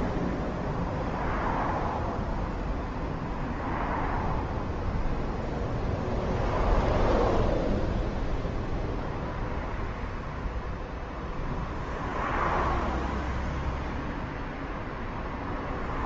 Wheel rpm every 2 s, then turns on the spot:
0, 0, 0, 0, 0, 0, 0, 0.
none